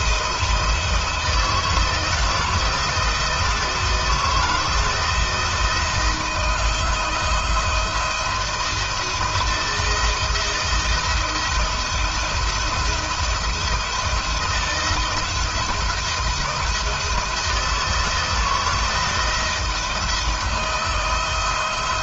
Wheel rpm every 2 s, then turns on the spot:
160, 170, 160, 160, 170, 170, 170, 170, 160, 170, 160.
none